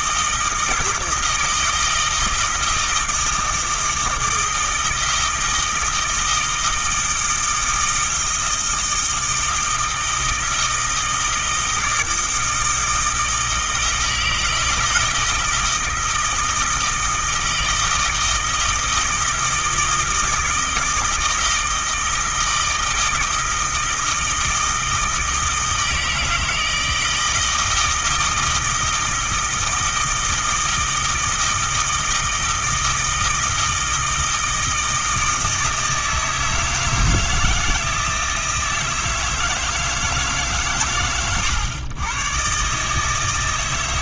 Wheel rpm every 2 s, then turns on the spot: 160, 160, 160, 160, 160, 160, 160, 160, 160, 160, 160, 160, 160, 160, 160, 160, 160, 160, 160, 160, 100, 140.
none